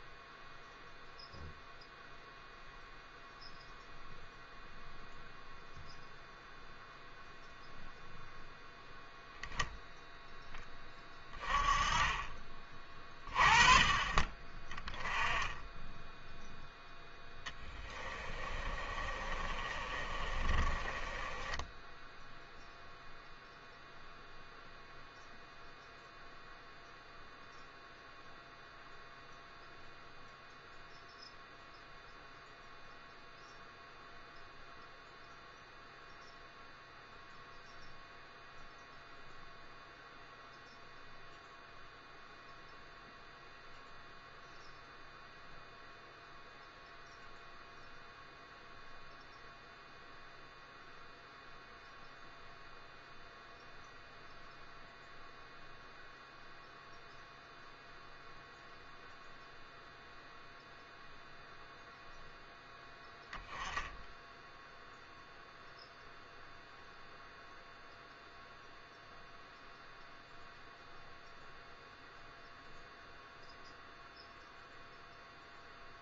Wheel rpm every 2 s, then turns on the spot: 0, 0, 0, 0, 0, 10, 30, 20, 10, 30, 30, 0, 0, 0, 0, 0, 0, 0, 0, 0, 0, 0, 0, 0, 0, 0, 0, 0, 0, 0, 0, 0, 0, 0, 0, 0, 0, 0.
18-22